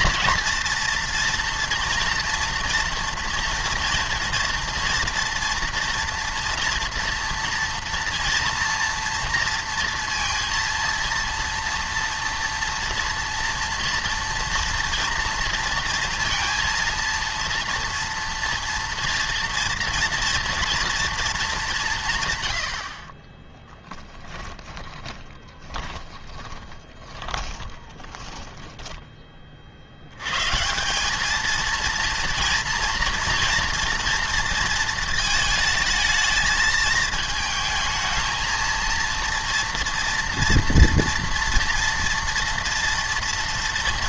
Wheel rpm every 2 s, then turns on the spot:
230, 230, 230, 240, 230, 230, 230, 230, 230, 230, 230, 80, 20, 20, 10, 160, 230, 230, 220, 230, 230, 230.
24-30